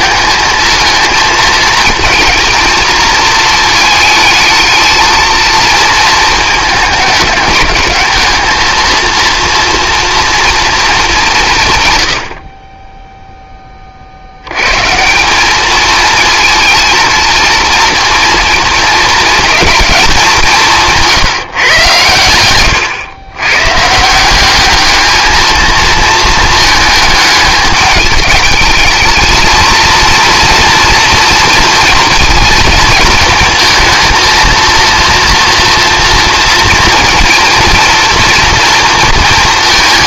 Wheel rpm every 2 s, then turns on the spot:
220, 230, 220, 210, 230, 230, 20, 140, 230, 230, 180, 110, 210, 220, 220, 230, 220, 230, 230, 230.
none